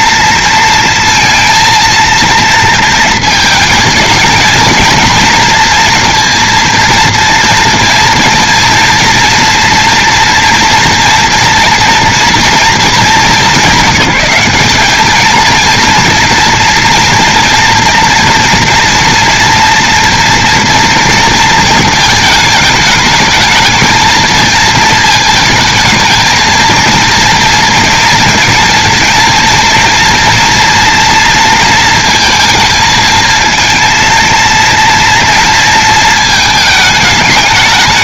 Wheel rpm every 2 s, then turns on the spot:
230, 230, 230, 230, 230, 240, 230, 200, 230, 230, 230, 220, 220, 220, 240, 230, 220, 230, 220.
none